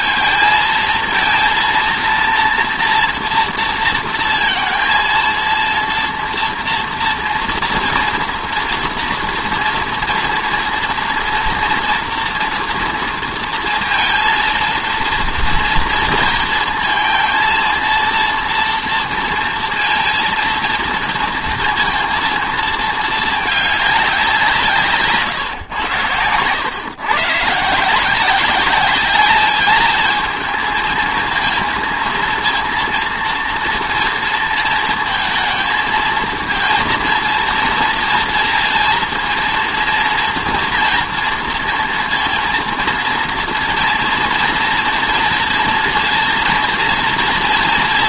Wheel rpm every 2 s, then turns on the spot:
220, 230, 230, 230, 230, 230, 240, 230, 230, 230, 230, 230, 170, 110, 190, 220, 230, 230, 230, 230, 230, 230, 230, 230.
none